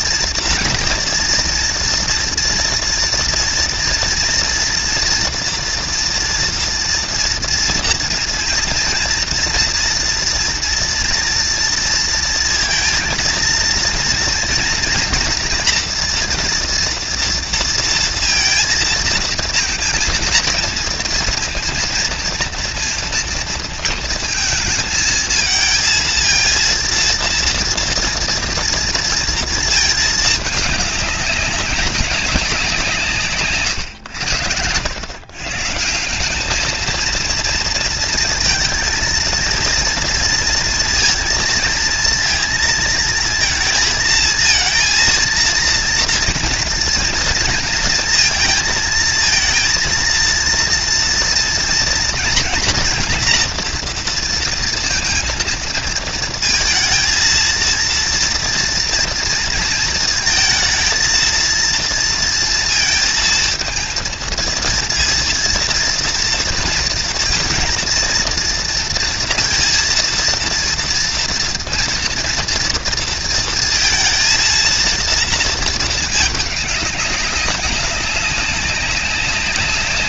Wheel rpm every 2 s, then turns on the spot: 230, 230, 230, 230, 230, 240, 230, 230, 230, 230, 230, 230, 220, 230, 230, 200, 160, 110, 220, 230, 230, 230, 230, 230, 230, 230, 230, 230, 230, 230, 230, 230, 230, 230, 230, 230, 230, 230, 200, 190.
none